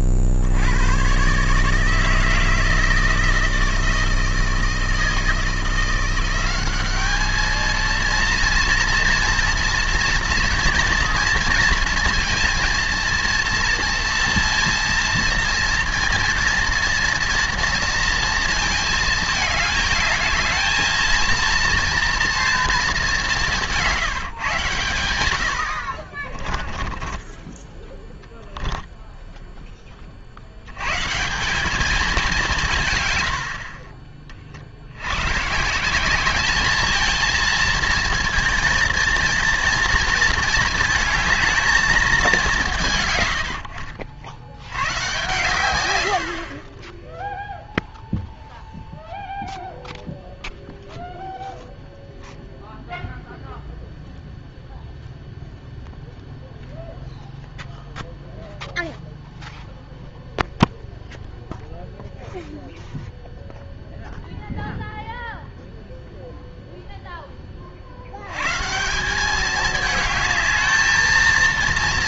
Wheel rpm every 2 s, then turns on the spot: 80, 160, 160, 190, 230, 240, 230, 230, 230, 220, 220, 230, 120, 20, 0, 80, 170, 60, 210, 230, 220, 160, 100, 40, 0, 0, 0, 0, 0, 0, 0, 0, 0, 0, 150, 220.
26-28 46-48